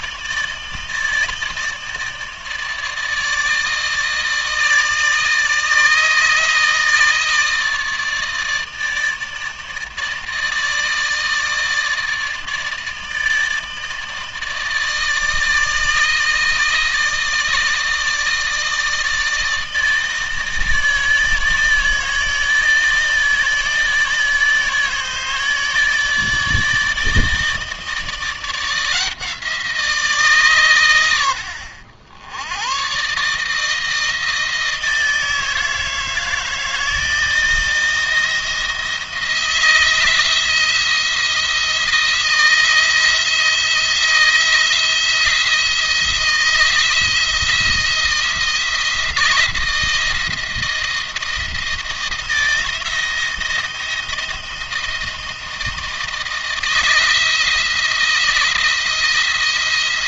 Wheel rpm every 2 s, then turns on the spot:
160, 160, 160, 160, 160, 160, 160, 160, 160, 160, 160, 160, 150, 160, 160, 130, 90, 160, 160, 160, 170, 160, 170, 170, 170, 170, 170, 170, 160, 170.
none